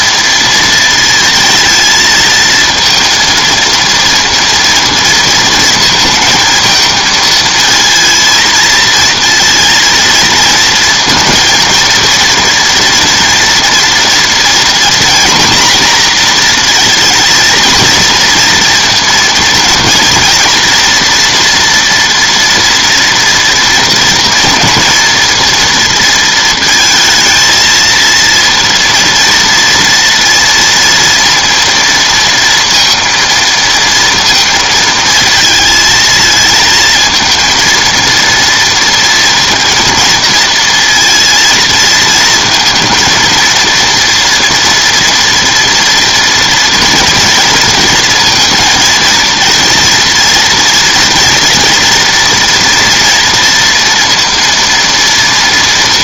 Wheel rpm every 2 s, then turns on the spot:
230, 230, 230, 220, 230, 230, 230, 240, 240, 230, 230, 230, 230, 230, 230, 230, 230, 230, 220, 230, 230, 230, 240, 230, 230, 230, 230, 230.
none